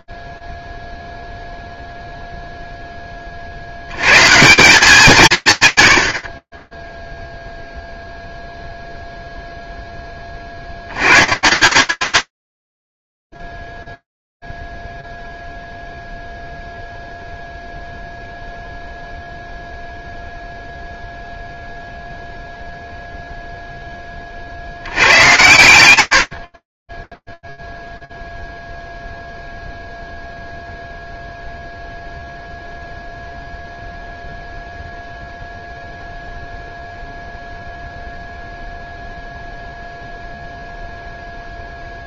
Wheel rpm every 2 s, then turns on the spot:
0, 10, 170, 10, 0, 110, 40, 0, 0, 0, 0, 0, 110, 20, 0, 0, 0, 0, 0, 0, 60.
12-14